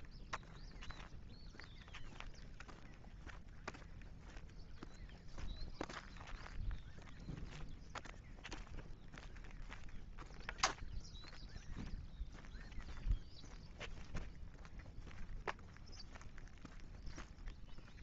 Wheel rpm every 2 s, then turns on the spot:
0, 0, 0, 0, 0, 0, 0, 0, 0.
none